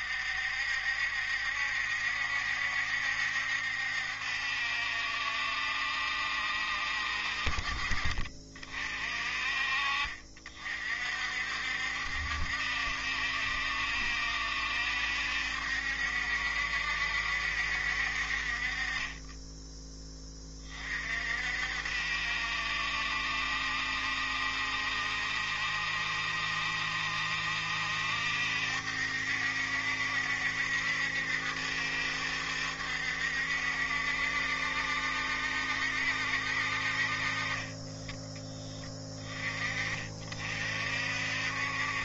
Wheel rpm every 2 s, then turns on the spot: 70, 70, 70, 60, 40, 50, 70, 70, 70, 30, 40, 70, 70, 70, 70, 70, 70, 70, 50, 20, 50.
none